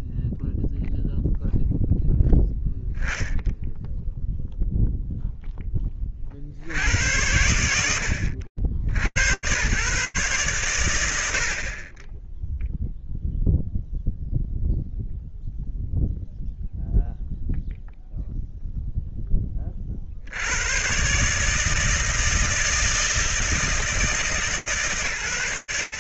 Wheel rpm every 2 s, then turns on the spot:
0, 10, 0, 80, 80, 120, 0, 0, 0, 0, 120, 160, 150.
none